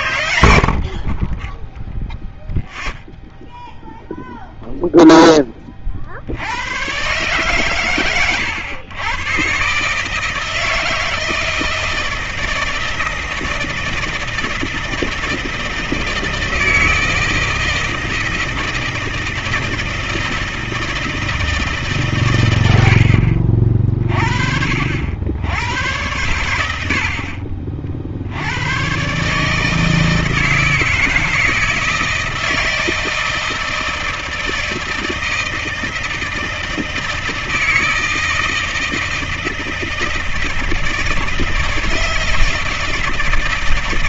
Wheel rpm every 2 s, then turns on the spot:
80, 0, 0, 110, 120, 160, 160, 160, 160, 160, 160, 100, 60, 80, 100, 160, 160, 160, 160, 160, 160, 160.
none